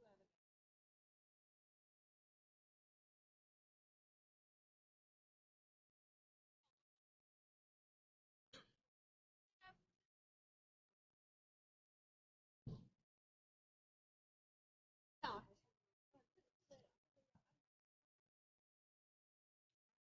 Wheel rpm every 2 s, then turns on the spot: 0, 0, 0, 0, 0, 0, 0, 0, 0, 0.
none